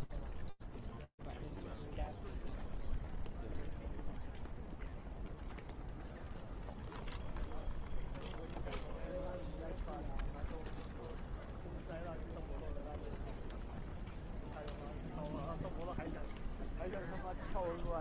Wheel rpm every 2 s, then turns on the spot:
0, 0, 0, 0, 0, 0, 0, 0, 0.
none